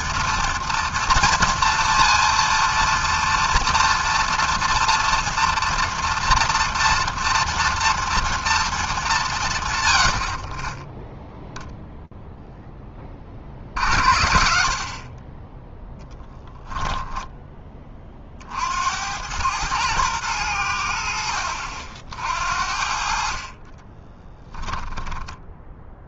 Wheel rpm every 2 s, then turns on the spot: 240, 230, 230, 230, 230, 30, 0, 60, 10, 50, 100, 60, 10.
14-18 24-26